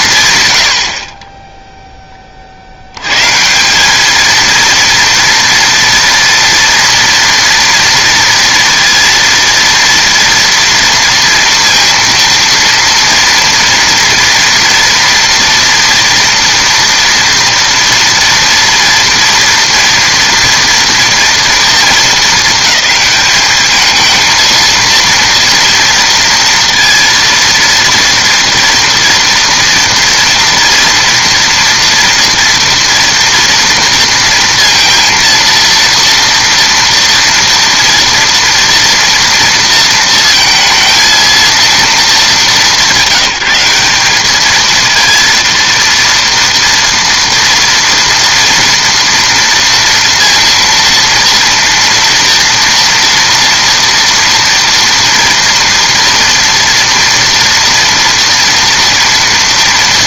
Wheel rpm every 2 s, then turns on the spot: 70, 70, 230, 240, 230, 230, 230, 230, 230, 240, 230, 220, 230, 230, 230, 230, 230, 230, 230, 230, 230, 210, 220, 240, 230, 230, 240, 230, 230, 240.
none